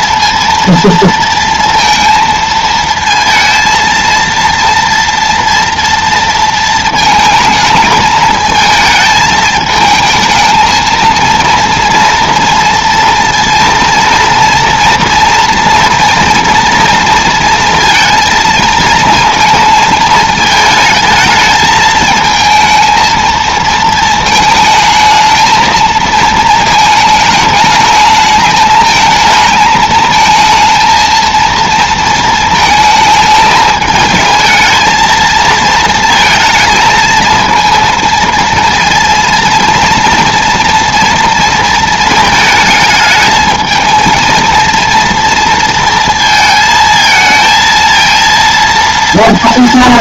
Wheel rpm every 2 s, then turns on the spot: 230, 220, 230, 220, 220, 220, 230, 230, 230, 230, 220, 220, 220, 220, 220, 220, 220, 220, 220, 230, 230, 220, 230, 220, 230.
none